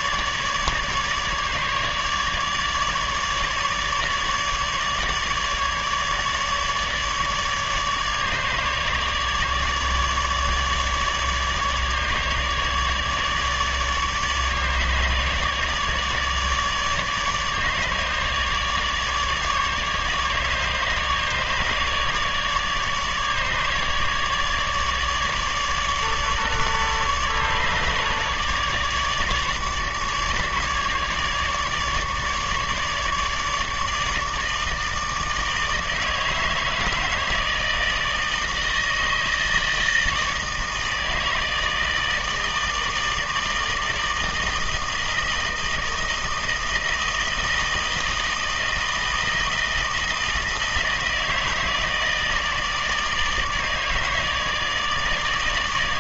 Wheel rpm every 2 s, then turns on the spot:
150, 150, 150, 150, 150, 150, 150, 150, 150, 150, 150, 150, 150, 150, 150, 150, 150, 160, 160, 160, 160, 160, 160, 160, 160, 160, 150, 150.
none